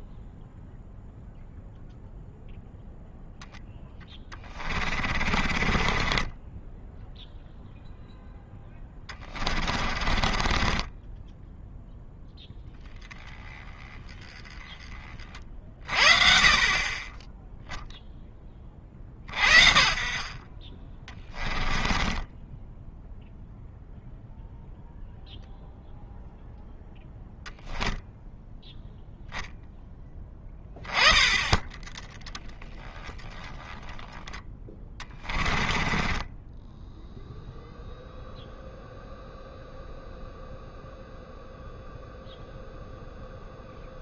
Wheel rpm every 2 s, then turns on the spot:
0, 0, 30, 10, 10, 20, 10, 20, 20, 40, 20, 10, 0, 0, 0, 10, 10, 20, 0, 0, 0, 0.
4-12 20-24 34-36